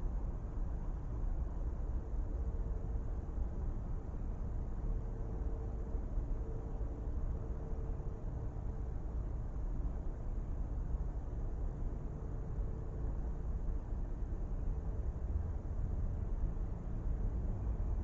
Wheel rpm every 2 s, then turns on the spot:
0, 0, 0, 0, 0, 0, 0, 0, 0.
none